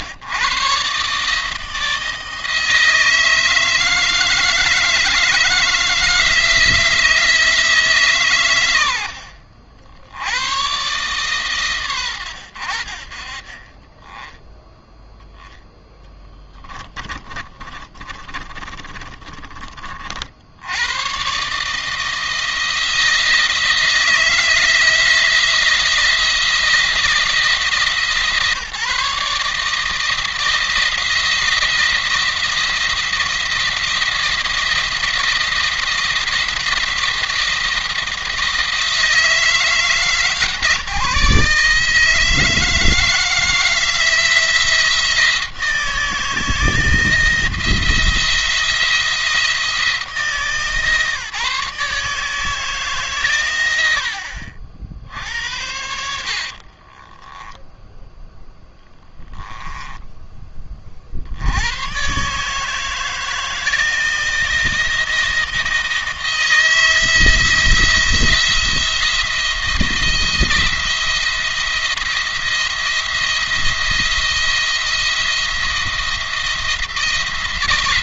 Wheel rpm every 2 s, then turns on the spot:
130, 160, 160, 170, 100, 100, 80, 0, 20, 30, 90, 160, 170, 170, 160, 170, 170, 170, 170, 160, 150, 160, 170, 170, 170, 150, 150, 60, 40, 10, 30, 150, 160, 160, 170, 170, 170, 170, 170.
16-20 56-58